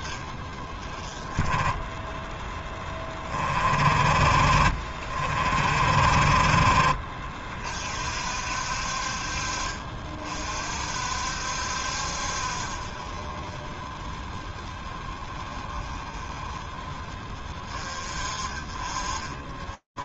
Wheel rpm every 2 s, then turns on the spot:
20, 30, 40, 50, 60, 40, 20, 30, 40, 30.
none